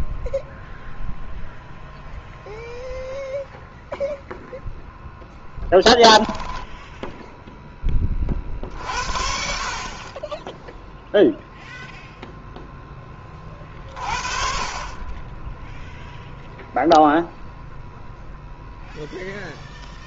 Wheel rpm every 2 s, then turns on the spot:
0, 0, 0, 10, 50, 10, 10, 40, 0, 0.
6-8